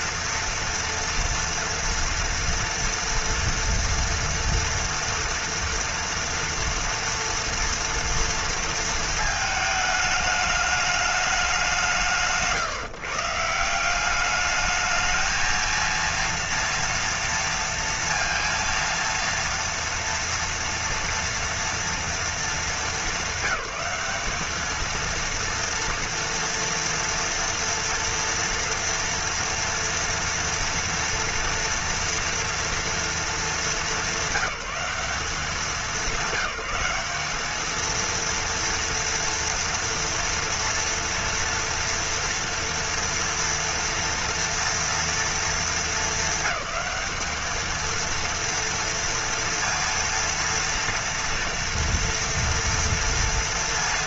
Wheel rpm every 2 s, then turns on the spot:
230, 230, 240, 230, 230, 210, 160, 210, 230, 230, 230, 210, 220, 230, 230, 230, 230, 190, 190, 230, 230, 230, 230, 210, 230, 230, 230.
none